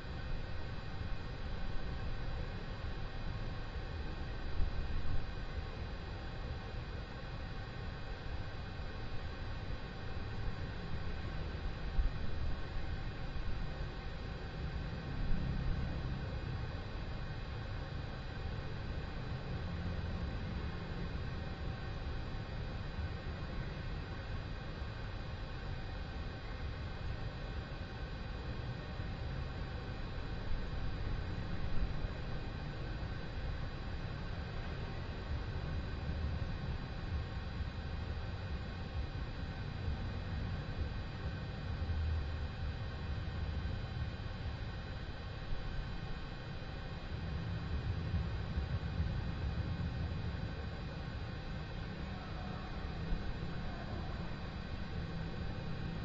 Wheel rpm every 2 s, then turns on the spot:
0, 0, 0, 0, 0, 0, 0, 0, 0, 0, 0, 0, 0, 0, 0, 0, 0, 0, 0, 0, 0, 0, 0, 0, 0, 0, 0, 0.
none